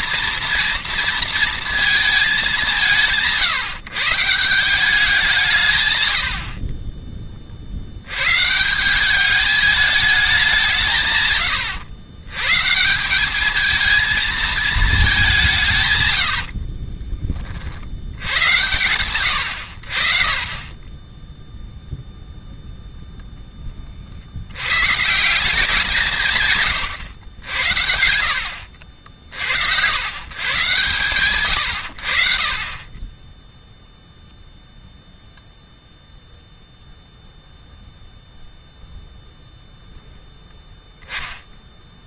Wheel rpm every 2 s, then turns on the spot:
230, 180, 180, 30, 170, 150, 160, 220, 50, 110, 20, 0, 110, 120, 70, 150, 30, 0, 0, 0, 10.
16-18